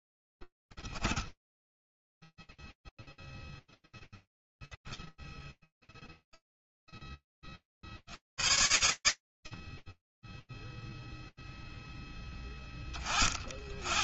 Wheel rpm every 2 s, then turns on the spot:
10, 10, 0, 0, 60, 10, 10.
none